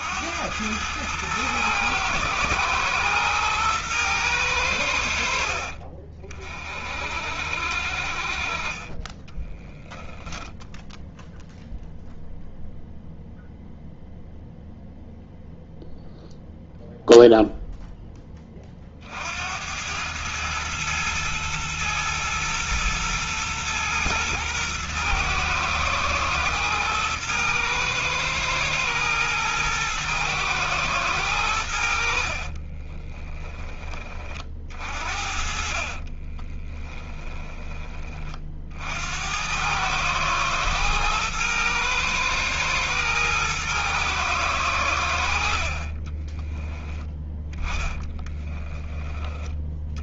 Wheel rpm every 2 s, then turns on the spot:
100, 110, 100, 40, 40, 10, 0, 0, 0, 30, 110, 110, 110, 110, 110, 110, 40, 40, 20, 50, 110, 110, 110, 20, 20.
32-34 36-38 46-50